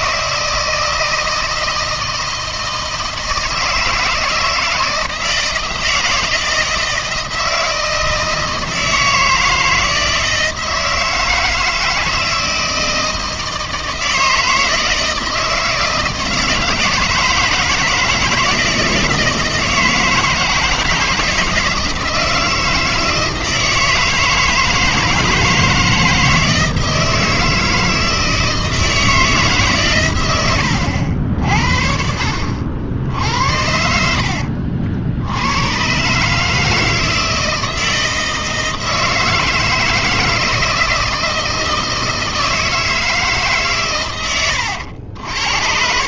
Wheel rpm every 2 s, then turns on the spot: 160, 160, 160, 160, 160, 160, 160, 160, 160, 160, 160, 160, 160, 160, 160, 90, 70, 70, 160, 160, 160, 160, 90.
30-32